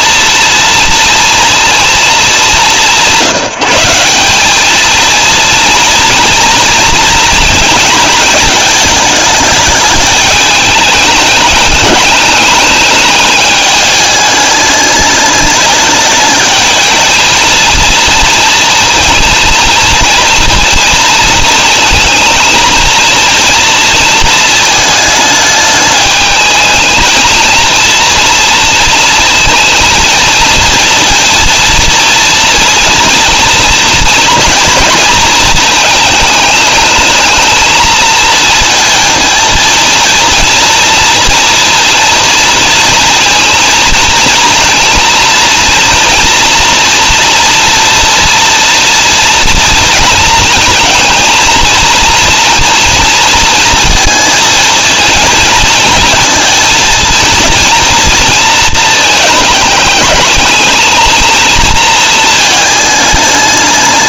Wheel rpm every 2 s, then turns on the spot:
230, 180, 230, 230, 220, 210, 210, 210, 220, 230, 230, 230, 220, 220, 230, 230, 230, 230, 220, 230, 230, 230, 230, 230, 230, 230, 230, 220, 230, 220, 220, 200.
none